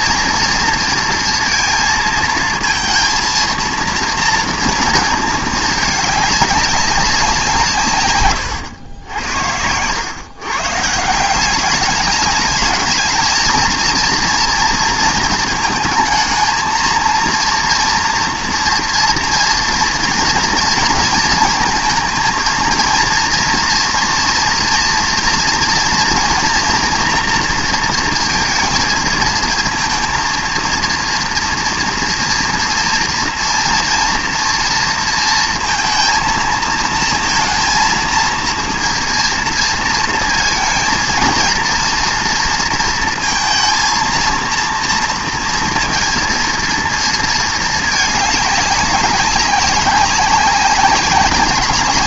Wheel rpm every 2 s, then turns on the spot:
230, 230, 230, 200, 100, 150, 220, 230, 230, 230, 230, 230, 240, 230, 220, 230, 240, 230, 230, 230, 230, 230, 230, 230, 200, 190.
none